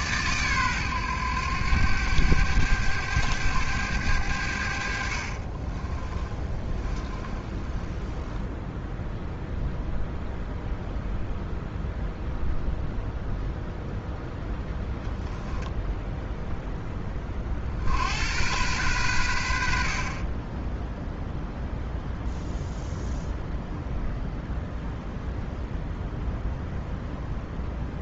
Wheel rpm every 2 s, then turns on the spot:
110, 100, 50, 20, 10, 0, 0, 10, 30, 100, 0, 0, 0, 0.
4-8